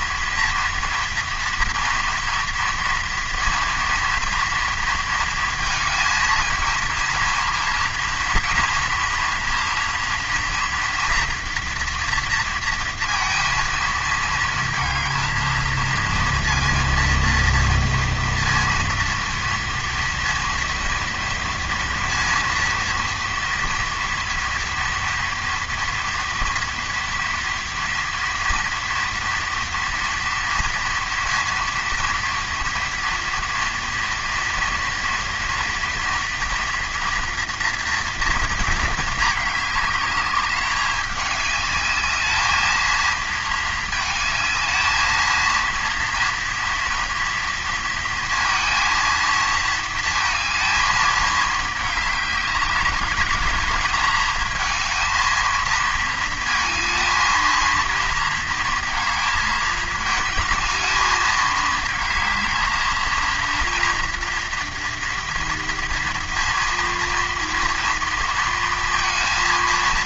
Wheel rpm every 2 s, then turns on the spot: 240, 230, 230, 230, 230, 240, 230, 220, 230, 230, 230, 230, 230, 230, 230, 230, 230, 230, 230, 230, 200, 220, 220, 230, 230, 220, 200, 220, 230, 230, 220, 220, 230, 230, 230.
none